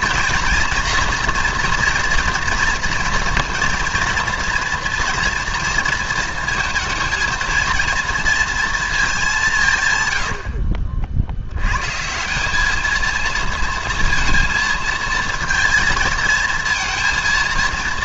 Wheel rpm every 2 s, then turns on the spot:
230, 230, 230, 230, 230, 60, 200, 230, 230.
10-12